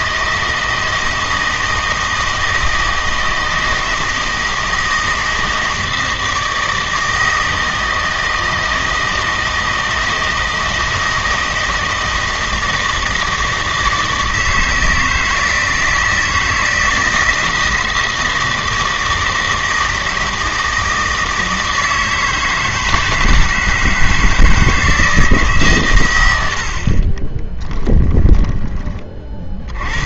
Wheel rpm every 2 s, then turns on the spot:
160, 160, 160, 160, 160, 160, 160, 160, 160, 160, 160, 160, 160, 70, 20.
none